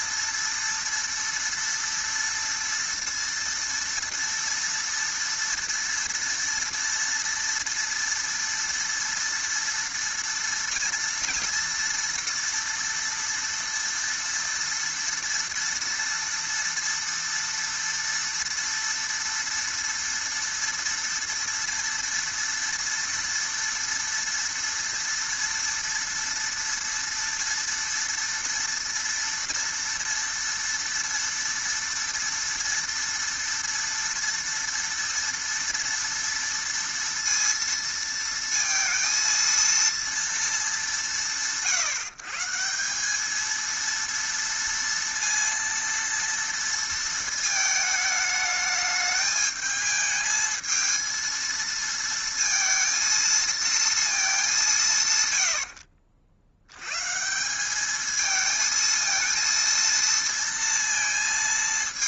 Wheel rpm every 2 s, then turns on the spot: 230, 230, 230, 230, 240, 230, 230, 230, 230, 230, 230, 230, 230, 230, 230, 230, 230, 230, 230, 230, 210, 170, 230, 230, 210, 220, 230, 160, 90, 220, 230.
none